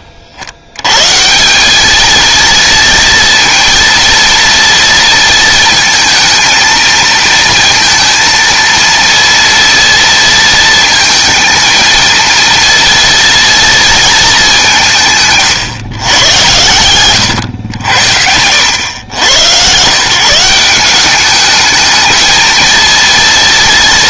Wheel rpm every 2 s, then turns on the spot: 80, 230, 230, 230, 230, 230, 230, 180, 110, 90, 180, 230.
16-18